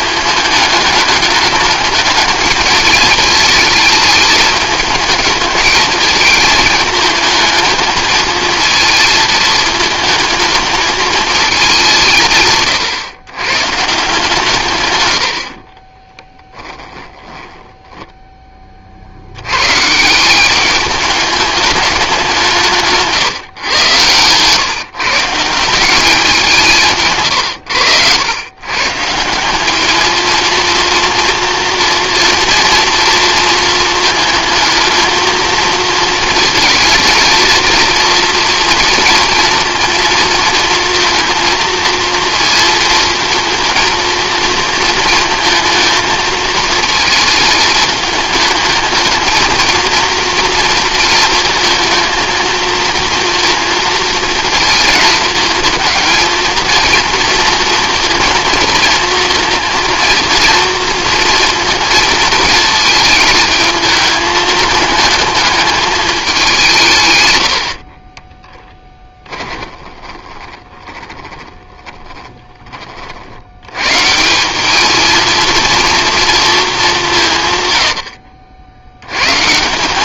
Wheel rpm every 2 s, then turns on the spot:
210, 210, 220, 220, 220, 220, 130, 140, 10, 40, 200, 160, 140, 160, 130, 230, 230, 230, 230, 230, 230, 230, 230, 220, 210, 230, 230, 230, 230, 230, 230, 220, 210, 170, 10, 20, 20, 200, 190, 70.
16-18 68-72